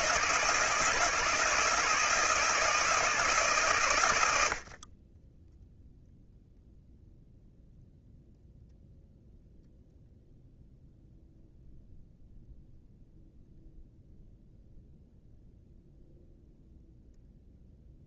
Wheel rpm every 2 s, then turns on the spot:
160, 160, 40, 0, 0, 0, 0, 0, 0.
none